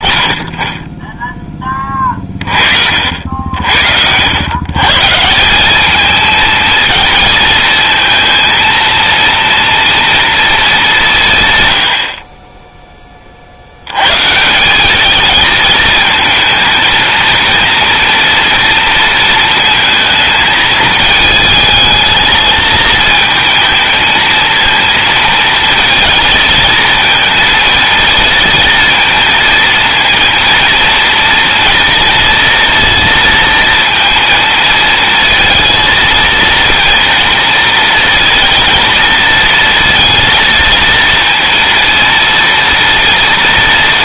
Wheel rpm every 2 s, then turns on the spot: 30, 50, 140, 230, 230, 190, 10, 200, 230, 230, 220, 220, 230, 230, 230, 230, 230, 230, 230, 230, 230, 230.
none